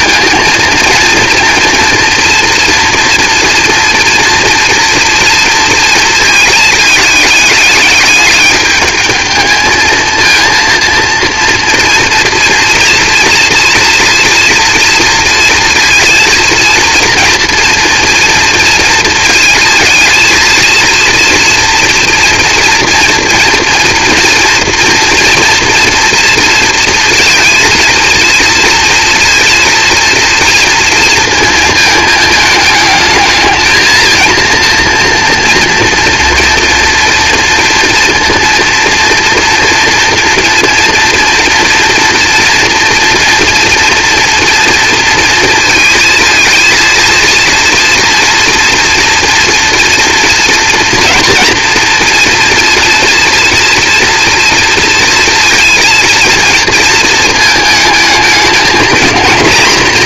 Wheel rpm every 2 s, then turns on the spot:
230, 230, 230, 220, 210, 230, 230, 240, 230, 230, 230, 230, 230, 230, 230, 230, 220, 230, 230, 230, 230, 240, 230, 230, 230, 230, 230, 230, 230, 220.
none